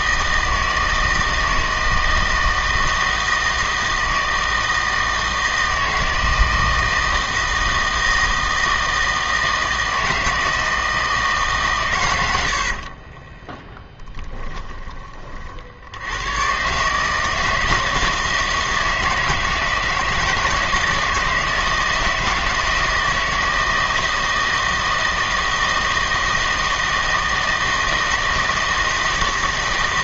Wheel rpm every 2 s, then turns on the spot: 160, 160, 160, 160, 160, 160, 70, 10, 140, 160, 160, 160, 160, 160, 160.
12-14